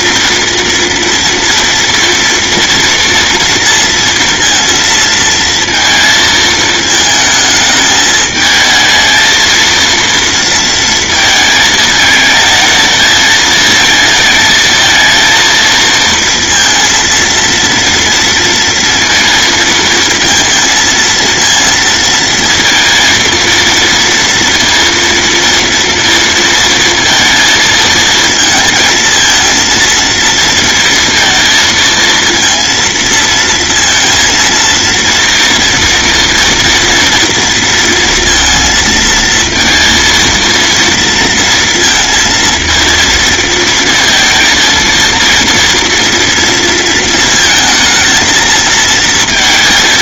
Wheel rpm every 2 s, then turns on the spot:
230, 230, 230, 220, 220, 230, 220, 220, 230, 230, 230, 230, 230, 230, 230, 230, 230, 230, 230, 230, 230, 230, 230, 230, 230.
none